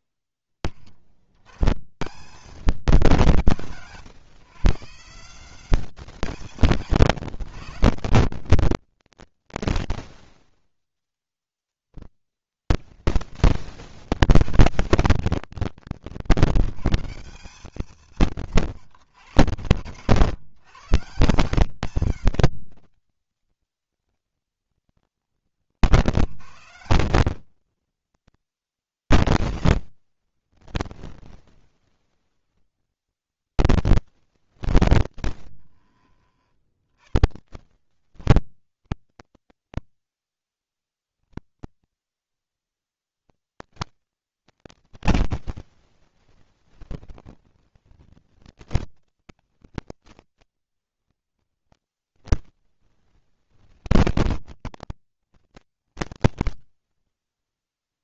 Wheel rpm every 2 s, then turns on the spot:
20, 190, 140, 170, 110, 20, 120, 170, 150, 120, 140, 130, 120, 150, 140, 110, 80, 50, 20, 70, 60, 50, 190, 80, 160, 110, 30, 130, 60.
34-36 40-42 54-58